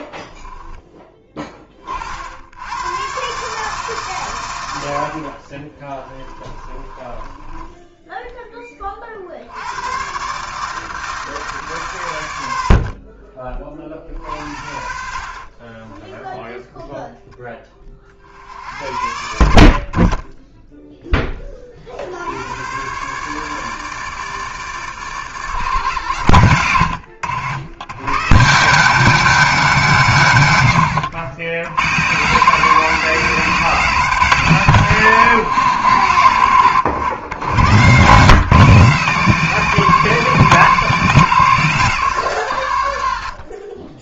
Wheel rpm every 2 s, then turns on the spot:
10, 100, 90, 20, 20, 150, 70, 60, 0, 80, 10, 110, 150, 100, 170, 100, 180, 140, 90, 160, 170, 120.
6-8 14-16